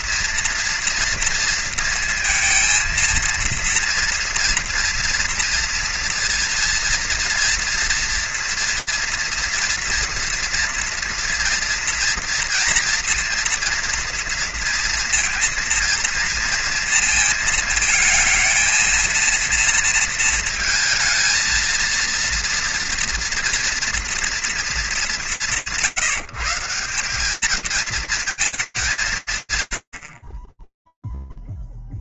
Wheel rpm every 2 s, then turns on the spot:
230, 230, 230, 230, 230, 230, 230, 230, 230, 220, 230, 230, 230, 160, 220, 50.
none